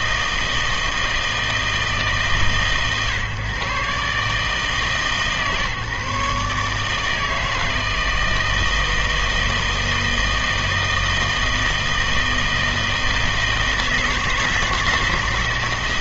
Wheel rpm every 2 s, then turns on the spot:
160, 140, 150, 150, 160, 160, 160, 160.
none